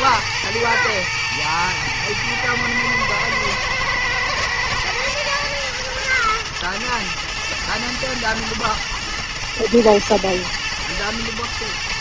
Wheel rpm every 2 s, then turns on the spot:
110, 110, 110, 120, 110, 110.
none